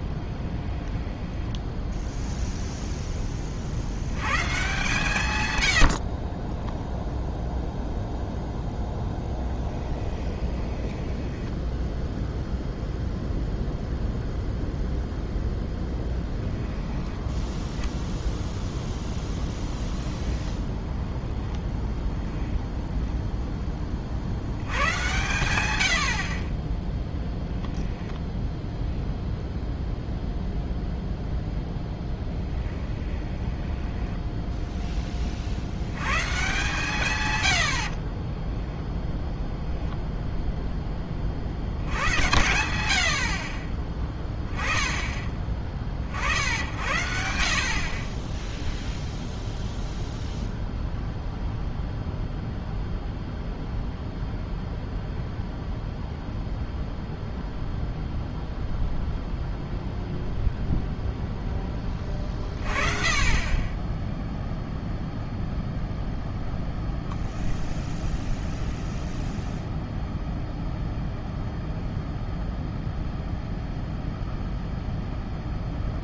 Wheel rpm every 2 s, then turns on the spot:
10, 0, 130, 20, 0, 20, 0, 0, 10, 0, 10, 0, 90, 30, 0, 0, 10, 10, 140, 10, 0, 90, 10, 60, 0, 0, 0, 0, 0, 0, 0, 30, 0, 0, 0, 0, 0, 0.
0-2 6-8 10-12 32-34 38-40